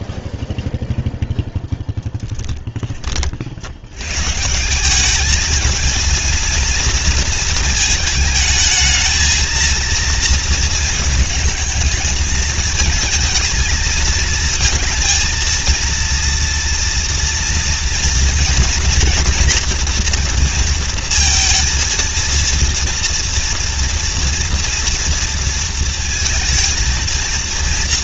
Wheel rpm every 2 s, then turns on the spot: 0, 10, 170, 230, 220, 230, 220, 230, 230, 230, 230, 230, 230, 230.
none